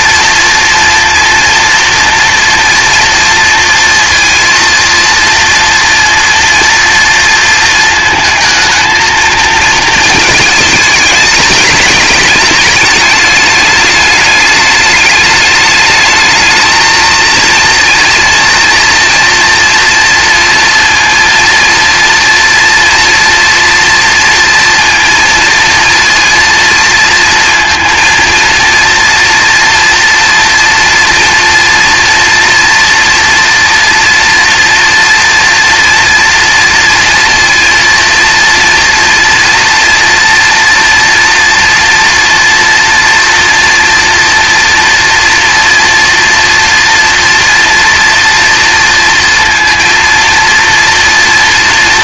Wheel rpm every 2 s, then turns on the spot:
230, 230, 230, 230, 220, 210, 210, 210, 220, 230, 230, 230, 230, 230, 230, 240, 240, 240, 230, 230, 230, 230, 240, 230, 230, 230.
none